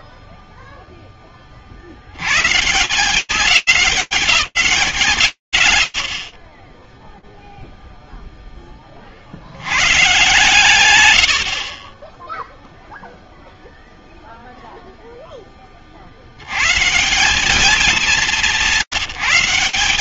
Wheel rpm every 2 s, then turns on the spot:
10, 180, 180, 20, 20, 120, 0, 0, 130, 160.
none